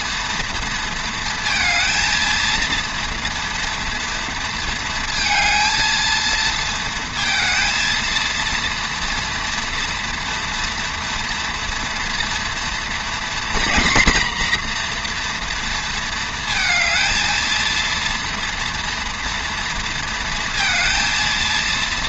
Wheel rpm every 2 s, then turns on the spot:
230, 230, 230, 230, 230, 230, 230, 240, 220, 230, 230.
none